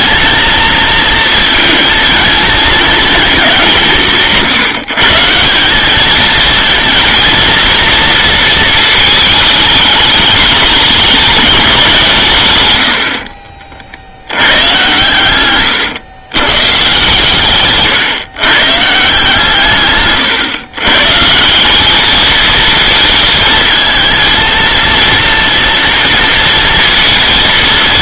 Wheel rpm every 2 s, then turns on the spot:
230, 230, 160, 230, 220, 210, 100, 100, 130, 140, 130, 220, 230, 230.
none